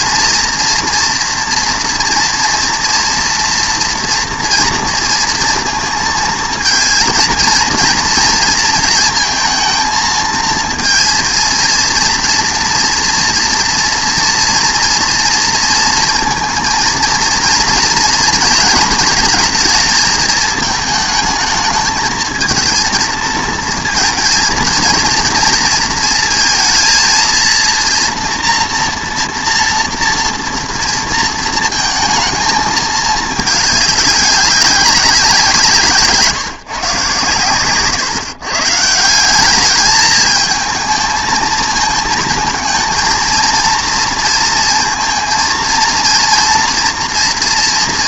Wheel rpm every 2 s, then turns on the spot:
230, 230, 230, 230, 230, 220, 230, 230, 230, 230, 220, 230, 230, 230, 230, 230, 220, 190, 130, 170, 220, 230, 230, 230.
none